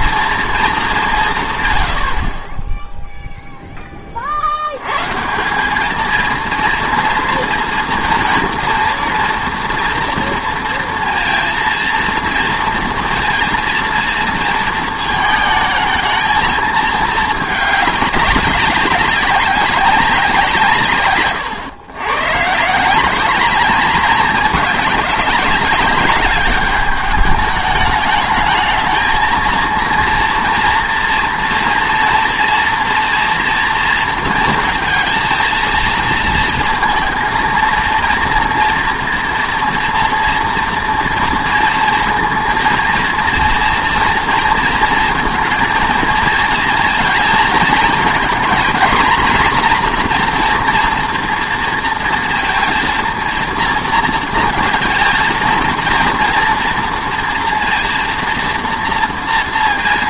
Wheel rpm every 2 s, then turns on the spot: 210, 20, 100, 230, 230, 230, 230, 220, 220, 190, 160, 150, 210, 200, 220, 230, 240, 230, 230, 230, 230, 230, 230, 230, 230, 240, 230, 230, 230, 230.
none